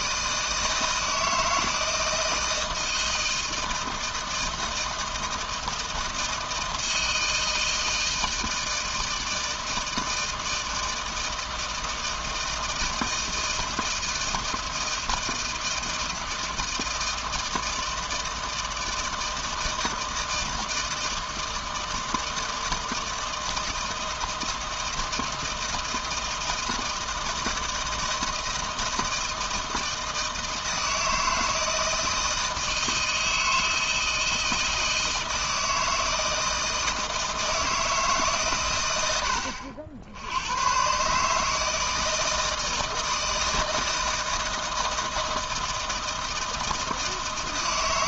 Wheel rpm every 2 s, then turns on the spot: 160, 160, 160, 160, 160, 160, 160, 160, 160, 160, 160, 160, 160, 160, 160, 160, 160, 160, 160, 120, 110, 160, 160, 160.
none